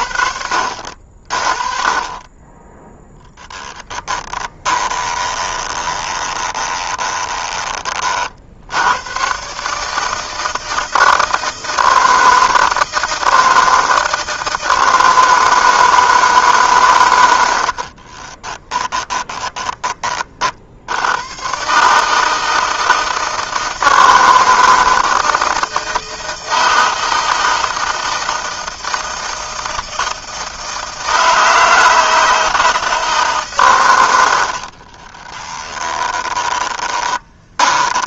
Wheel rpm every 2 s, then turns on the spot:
60, 10, 20, 20, 90, 160, 160, 160, 130, 20, 70, 160, 160, 160, 160, 160, 160, 30, 20.
4-8 18-20 34-38